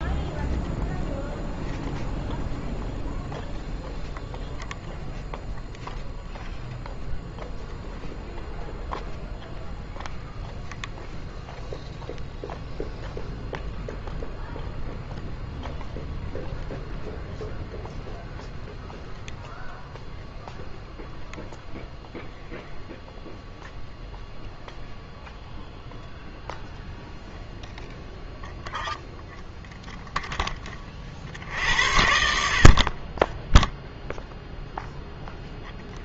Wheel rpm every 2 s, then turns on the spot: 0, 0, 0, 0, 0, 0, 0, 0, 0, 0, 0, 0, 0, 0, 0, 20, 50, 0.
none